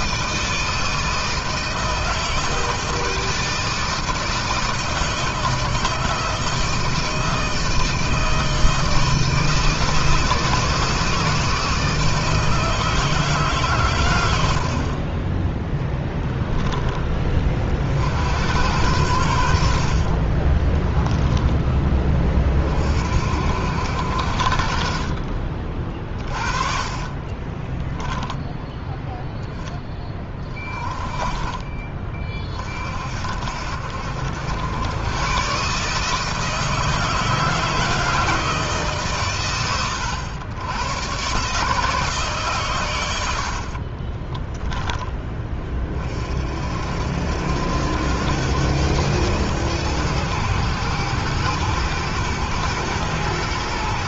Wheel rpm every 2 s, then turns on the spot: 160, 160, 160, 160, 160, 160, 160, 60, 20, 90, 20, 40, 50, 30, 10, 30, 40, 90, 160, 150, 110, 120, 20, 60, 100, 110, 110.
14-16 20-22 44-46